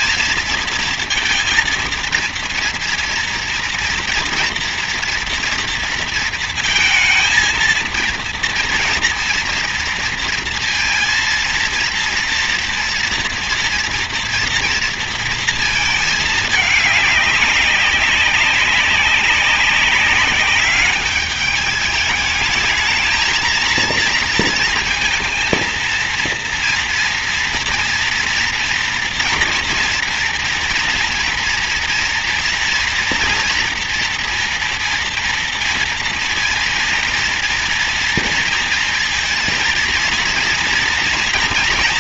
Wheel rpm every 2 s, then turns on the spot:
230, 230, 230, 230, 230, 230, 230, 230, 200, 190, 210, 220, 230, 230, 230, 230, 240, 230, 230, 230, 230.
none